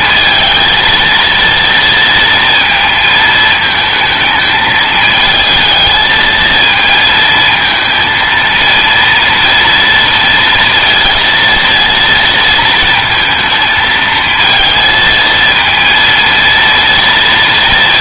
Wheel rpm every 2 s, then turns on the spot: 230, 230, 220, 220, 230, 230, 230, 220, 230.
none